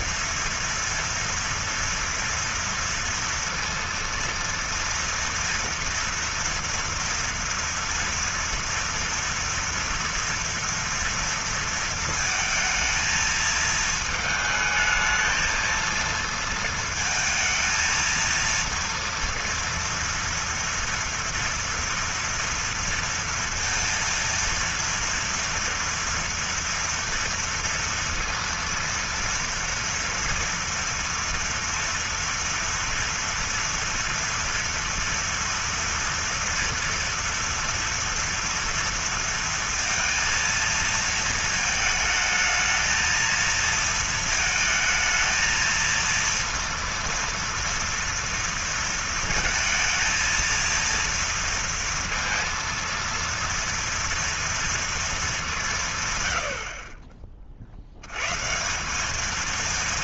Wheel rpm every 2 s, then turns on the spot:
230, 230, 230, 230, 230, 230, 220, 220, 230, 230, 230, 230, 230, 230, 230, 230, 230, 240, 230, 230, 230, 220, 230, 230, 230, 230, 230, 230, 80, 150.
none